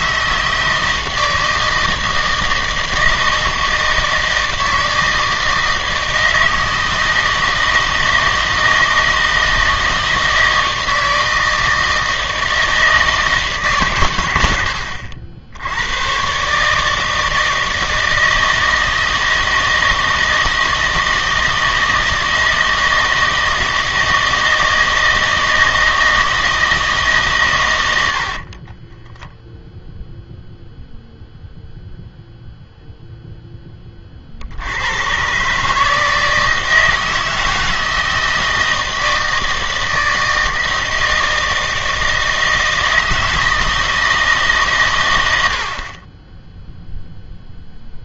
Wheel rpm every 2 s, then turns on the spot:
160, 160, 160, 160, 160, 160, 160, 90, 150, 160, 160, 160, 160, 160, 20, 0, 0, 80, 160, 160, 160, 160, 140, 0.
28-30